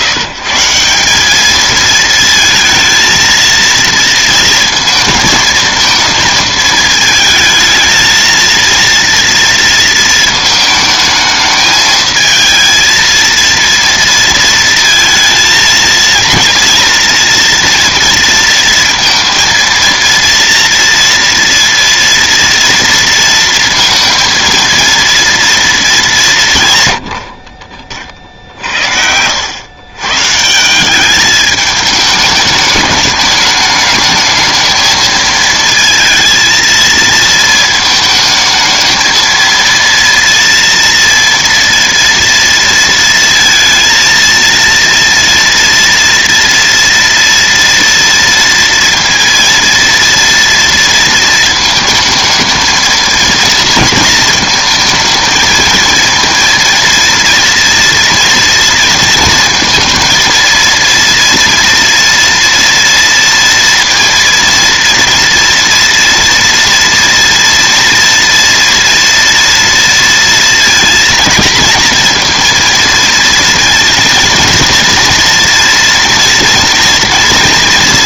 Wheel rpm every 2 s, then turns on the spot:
140, 230, 230, 220, 230, 220, 220, 230, 230, 230, 230, 230, 230, 150, 60, 160, 210, 220, 230, 220, 230, 230, 230, 230, 230, 230, 220, 220, 230, 230, 230, 230, 230, 230, 230, 230, 230, 230, 230.
none